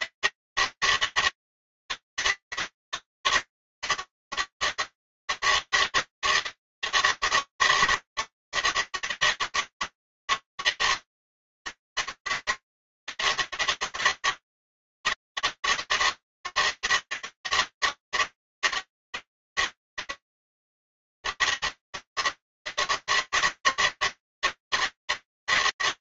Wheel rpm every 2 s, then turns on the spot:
160, 160, 160, 160, 150, 160, 160, 160, 160, 160, 160, 150, 160.
none